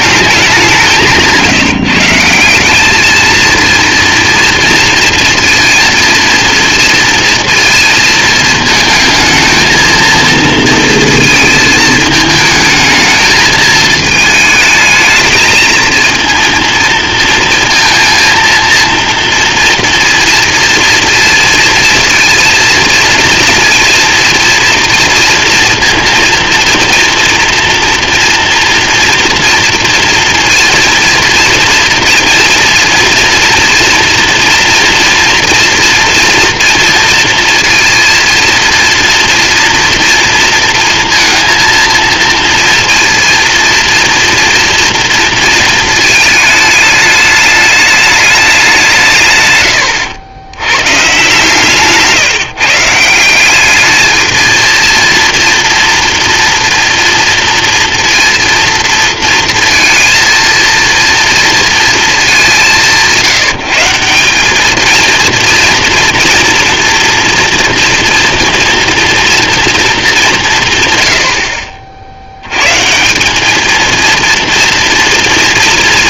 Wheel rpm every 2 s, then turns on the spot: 190, 200, 230, 230, 230, 230, 220, 220, 230, 230, 230, 230, 230, 230, 230, 230, 230, 230, 230, 230, 230, 230, 230, 210, 190, 110, 150, 230, 230, 230, 230, 180, 210, 230, 230, 150, 130, 230.
none